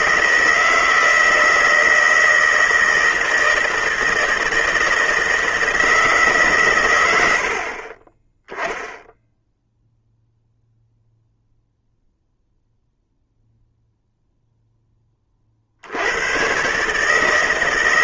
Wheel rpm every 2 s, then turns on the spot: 160, 160, 160, 130, 10, 0, 0, 10, 130.
none